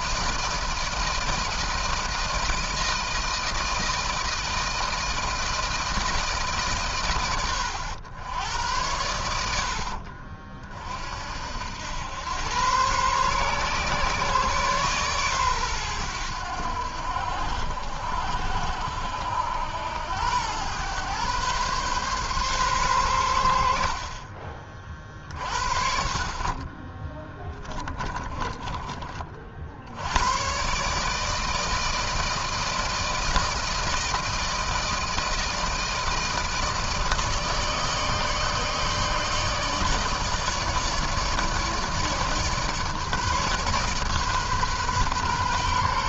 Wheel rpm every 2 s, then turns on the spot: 160, 160, 160, 150, 90, 50, 110, 130, 90, 70, 110, 130, 40, 40, 20, 120, 160, 160, 160, 150, 150, 150, 140.
28-30